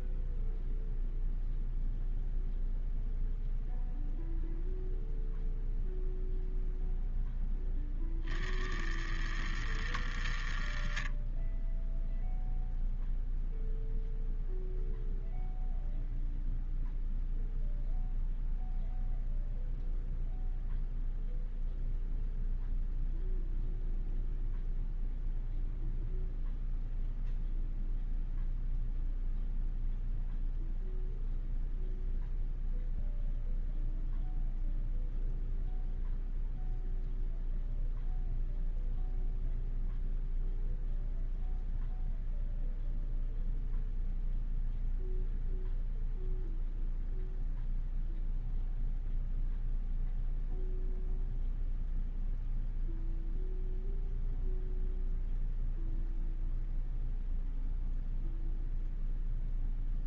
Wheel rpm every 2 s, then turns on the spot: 0, 0, 0, 0, 70, 30, 0, 0, 0, 0, 0, 0, 0, 0, 0, 0, 0, 0, 0, 0, 0, 0, 0, 0, 0, 0, 0, 0, 0, 0.
none